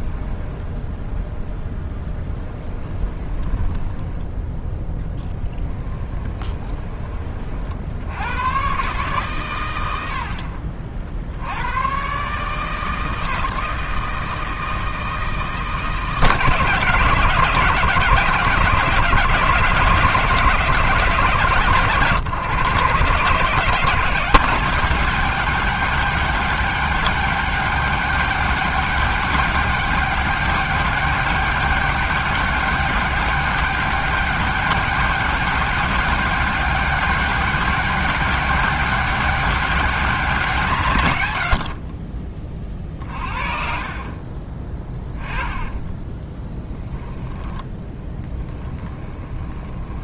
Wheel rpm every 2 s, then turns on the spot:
0, 10, 10, 20, 140, 50, 160, 160, 150, 160, 160, 140, 200, 200, 200, 200, 200, 210, 200, 200, 140, 30, 20, 10, 10.
2-4 44-50